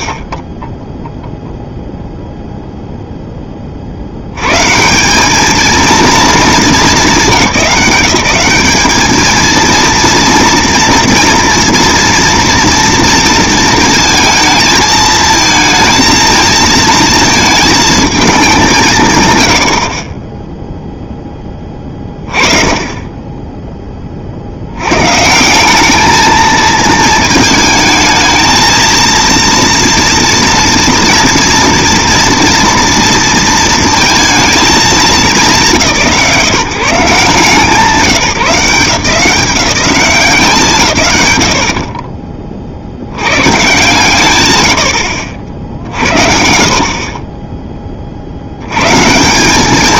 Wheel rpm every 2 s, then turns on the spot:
0, 0, 160, 190, 210, 230, 230, 220, 230, 150, 0, 20, 130, 220, 230, 240, 230, 210, 140, 160, 160, 60, 80, 50, 100.
none